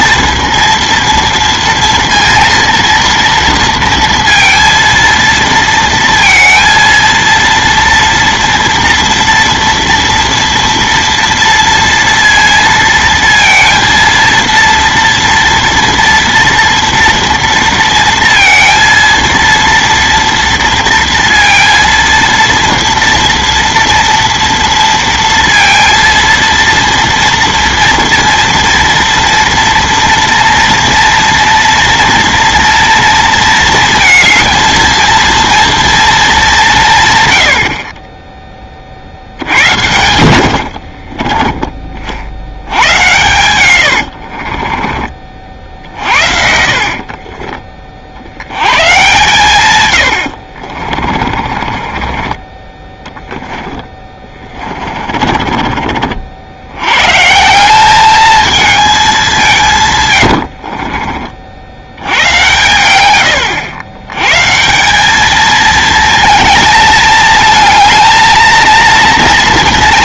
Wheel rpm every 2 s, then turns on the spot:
230, 230, 230, 230, 230, 230, 230, 230, 240, 230, 230, 230, 230, 230, 230, 230, 230, 220, 180, 30, 70, 90, 30, 60, 100, 70, 20, 30, 90, 220, 60, 110, 160, 220, 230.
40-42 44-46 50-56 60-62